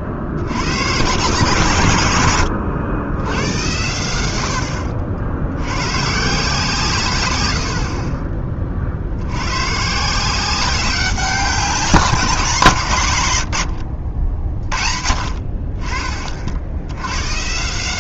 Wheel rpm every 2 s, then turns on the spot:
80, 100, 80, 160, 30, 180, 180, 50, 40.
2-6